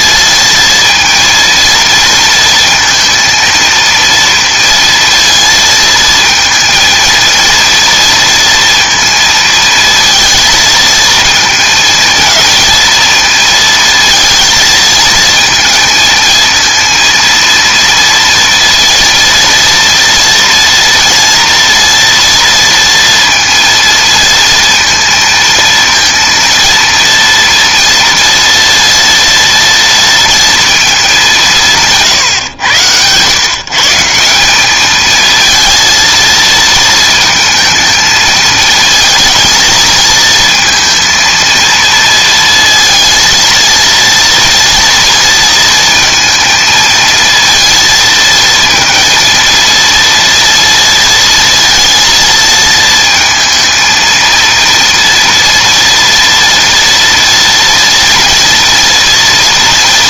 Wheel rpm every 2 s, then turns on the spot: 230, 230, 230, 230, 230, 230, 220, 220, 220, 230, 230, 230, 230, 230, 230, 220, 120, 210, 230, 220, 230, 230, 230, 220, 230, 230, 220, 230, 230, 230.
none